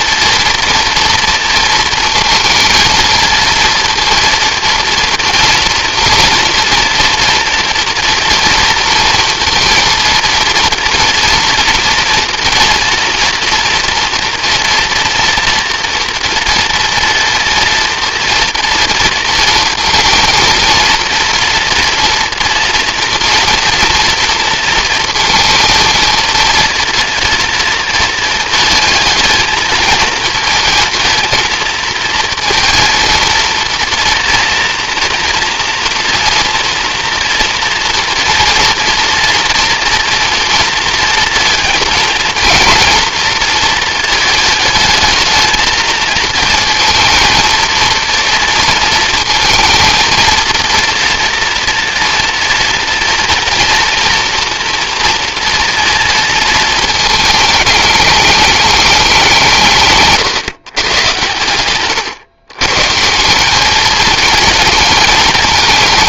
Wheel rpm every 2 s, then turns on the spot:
230, 230, 240, 240, 230, 230, 230, 230, 240, 230, 230, 240, 230, 220, 220, 230, 230, 230, 240, 230, 240, 230, 220, 220, 230, 230, 230, 230, 220, 210, 130, 130, 220.
none